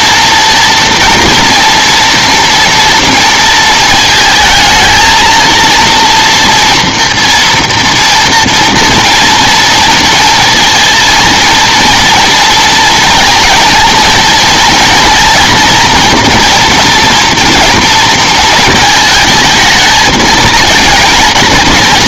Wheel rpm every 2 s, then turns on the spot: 230, 230, 220, 230, 230, 230, 230, 230, 230, 220, 230.
none